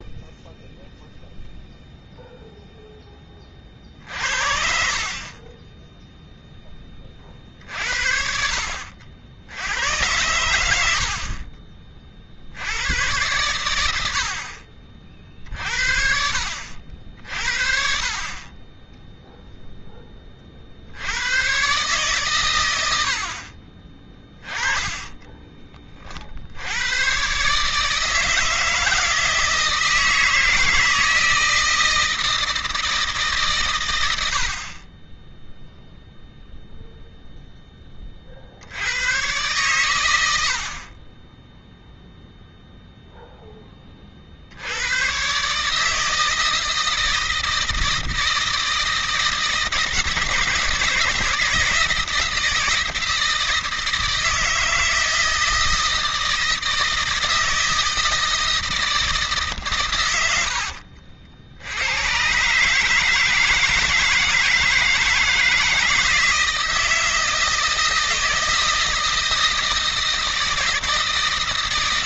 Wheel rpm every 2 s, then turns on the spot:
0, 10, 50, 20, 60, 80, 80, 50, 60, 20, 50, 90, 20, 90, 160, 160, 160, 70, 0, 80, 40, 0, 90, 160, 160, 160, 160, 160, 160, 160, 70, 150, 160, 160, 160, 160.
24-26 60-62